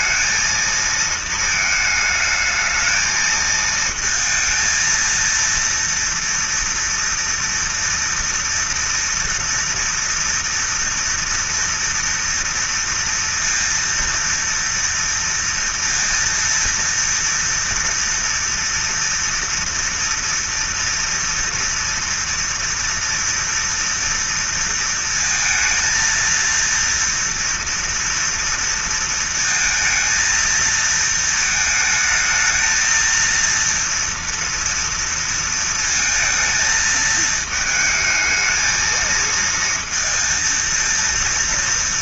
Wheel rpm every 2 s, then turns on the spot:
230, 220, 230, 230, 230, 240, 230, 230, 230, 230, 230, 230, 230, 230, 230, 220, 220, 230, 230, 220, 230.
none